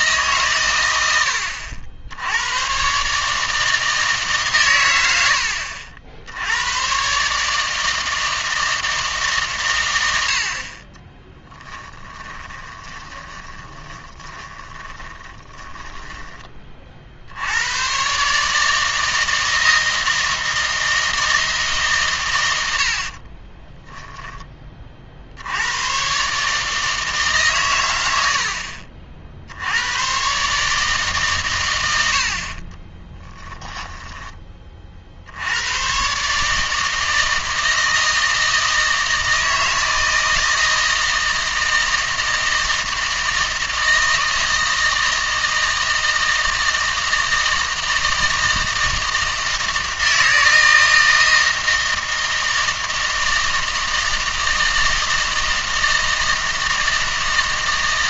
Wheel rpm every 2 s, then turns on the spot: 120, 120, 100, 120, 160, 30, 20, 30, 40, 150, 160, 80, 30, 150, 60, 150, 30, 40, 160, 160, 160, 160, 160, 160, 160, 160, 160, 160, 160.
12-16 32-34